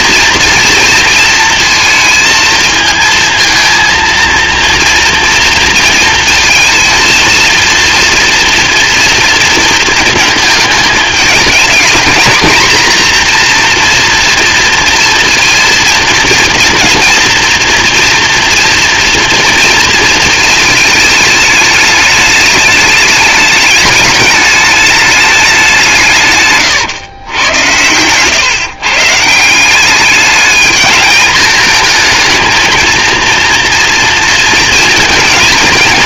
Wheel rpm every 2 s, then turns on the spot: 230, 230, 230, 230, 230, 220, 230, 230, 230, 230, 220, 210, 210, 130, 140, 220, 230, 230.
none